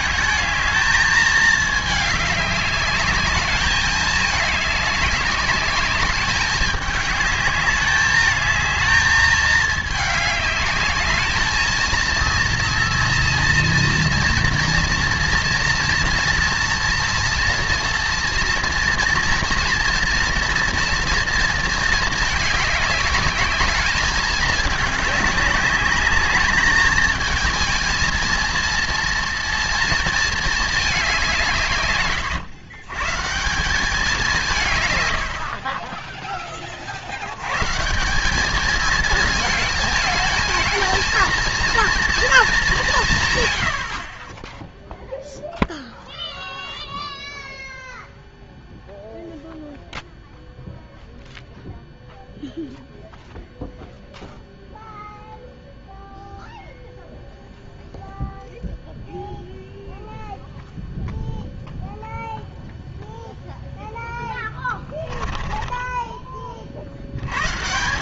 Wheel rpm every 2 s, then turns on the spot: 220, 200, 210, 200, 220, 210, 230, 230, 240, 230, 230, 210, 210, 210, 230, 220, 120, 140, 30, 210, 220, 200, 0, 0, 0, 0, 0, 0, 0, 0, 0, 0, 20, 50.
64-66